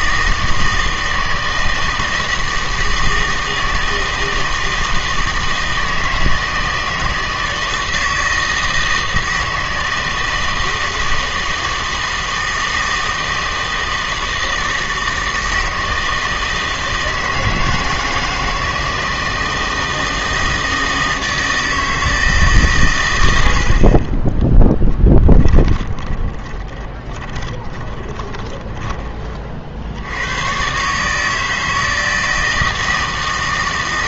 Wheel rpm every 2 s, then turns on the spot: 160, 160, 160, 160, 160, 160, 160, 160, 160, 160, 160, 140, 10, 30, 20, 130, 160.
24-30